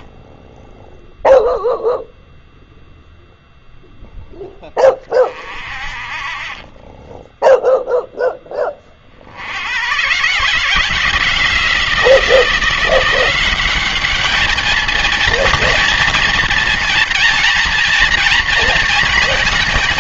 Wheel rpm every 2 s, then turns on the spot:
0, 0, 10, 30, 20, 160, 170, 220, 230, 230.
none